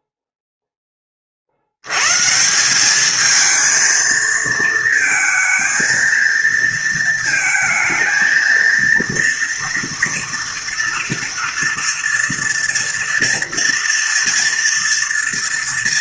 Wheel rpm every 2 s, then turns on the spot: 10, 180, 230, 230, 230, 230, 230, 230.
none